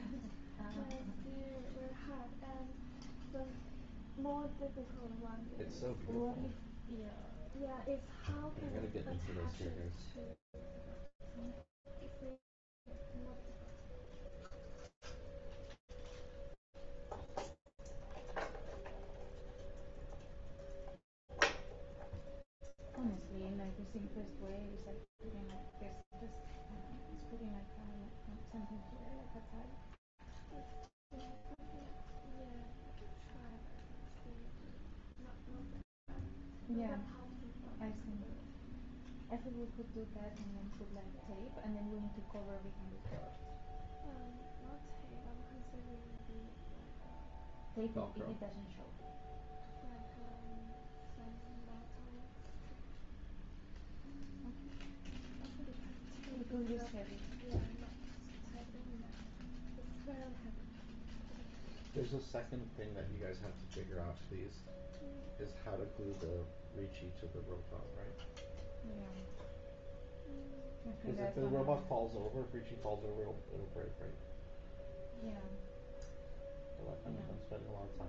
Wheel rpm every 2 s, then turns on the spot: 0, 0, 0, 0, 0, 0, 0, 0, 0, 0, 0, 0, 0, 0, 0, 0, 0, 0, 0, 0, 0, 0, 0, 0, 0, 0, 0, 0, 0, 0, 0, 0, 0, 0, 0, 0, 0, 0, 0.
none